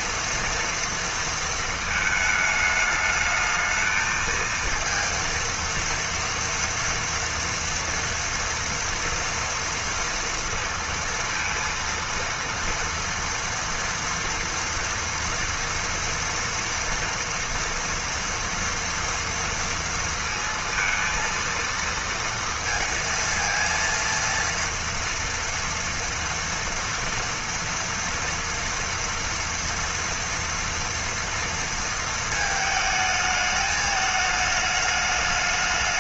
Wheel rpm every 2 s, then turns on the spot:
230, 210, 230, 230, 230, 230, 230, 230, 240, 230, 230, 230, 230, 230, 230, 240, 220, 210.
none